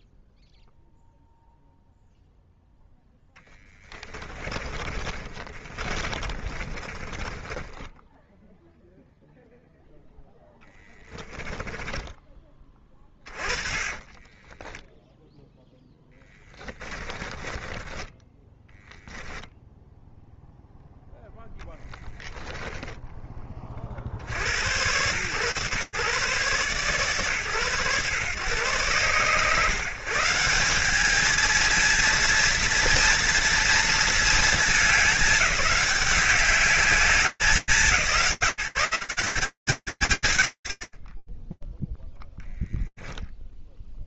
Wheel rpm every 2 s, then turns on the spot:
0, 0, 30, 20, 0, 10, 20, 20, 20, 10, 0, 20, 120, 130, 120, 200, 230, 220, 200, 170, 40, 0.
4-8 10-12 14-20 22-24